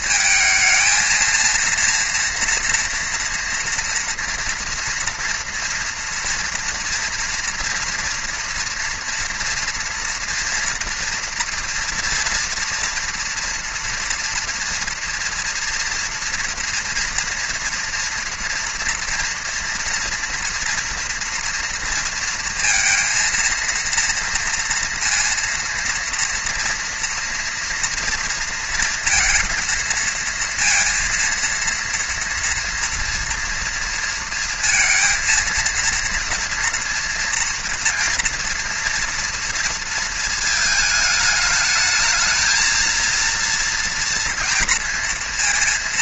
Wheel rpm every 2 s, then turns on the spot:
220, 230, 230, 230, 230, 240, 230, 230, 230, 230, 240, 230, 230, 230, 230, 230, 230, 230, 230, 230, 220, 220, 230.
none